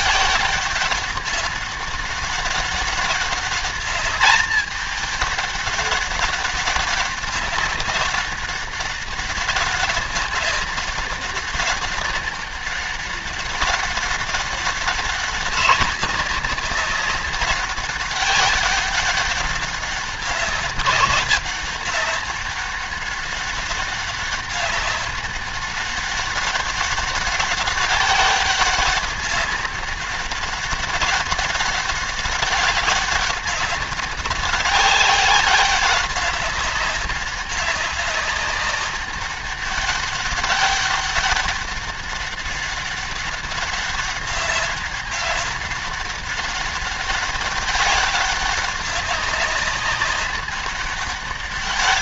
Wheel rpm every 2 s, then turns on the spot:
190, 200, 210, 200, 200, 200, 200, 200, 200, 200, 190, 200, 200, 200, 190, 200, 200, 200, 200, 200, 200, 200, 200, 200, 190, 200.
none